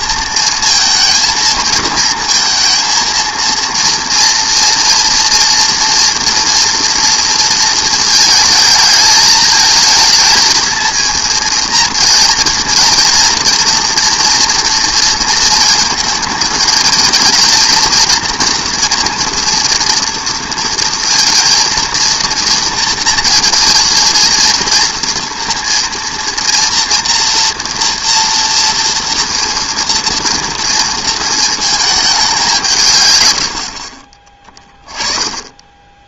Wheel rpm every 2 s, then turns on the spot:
230, 230, 240, 240, 220, 230, 230, 230, 220, 230, 230, 230, 230, 230, 230, 230, 190, 20.
none